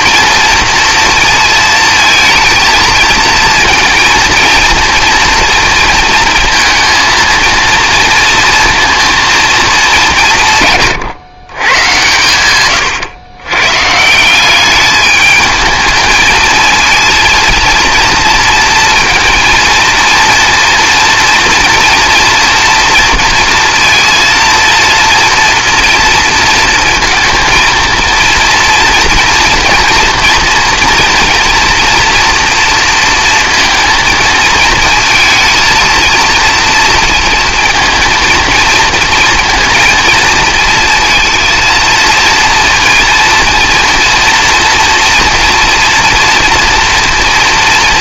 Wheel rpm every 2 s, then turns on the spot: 230, 220, 230, 230, 230, 140, 130, 190, 220, 230, 230, 230, 230, 230, 230, 230, 230, 230, 230, 230, 230, 230, 240, 230.
none